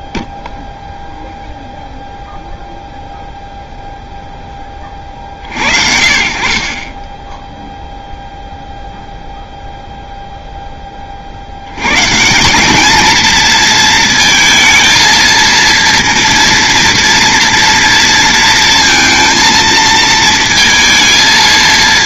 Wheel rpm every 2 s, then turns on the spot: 0, 0, 20, 40, 0, 10, 190, 220, 230, 230, 230.
none